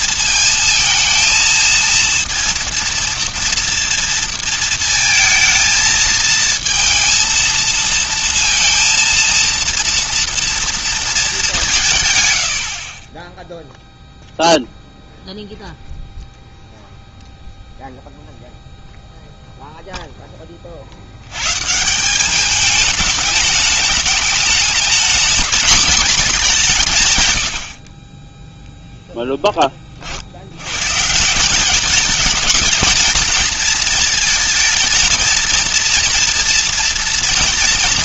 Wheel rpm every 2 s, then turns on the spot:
230, 230, 230, 230, 230, 230, 70, 0, 0, 0, 30, 200, 220, 190, 0, 90, 220, 230, 240.
none